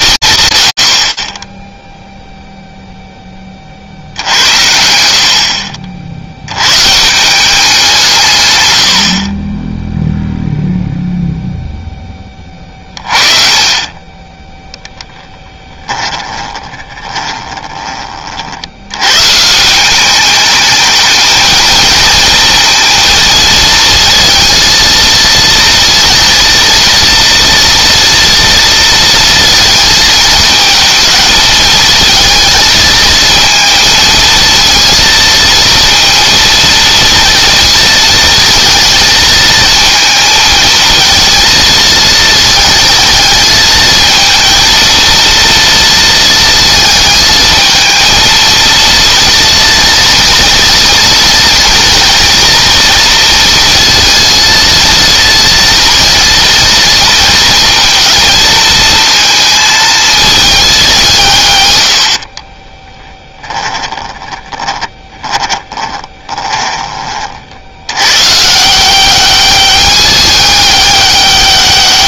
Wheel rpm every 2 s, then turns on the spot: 100, 0, 80, 140, 80, 0, 30, 0, 20, 120, 220, 230, 230, 230, 230, 220, 220, 230, 230, 230, 220, 220, 230, 220, 230, 230, 230, 230, 230, 220, 190, 10, 20, 30, 180, 200.
12-14 16-18 62-66